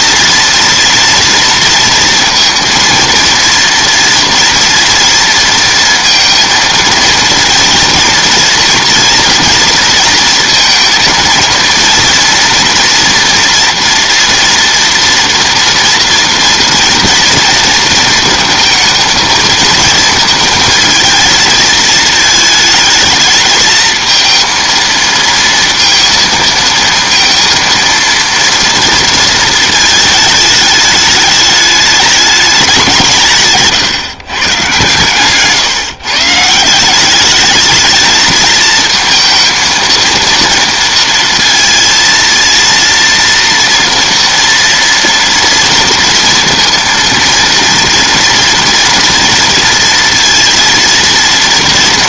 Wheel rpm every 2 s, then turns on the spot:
230, 230, 230, 230, 230, 220, 230, 230, 230, 230, 220, 220, 230, 230, 230, 210, 190, 130, 160, 220, 230, 230, 230, 230, 230, 230.
none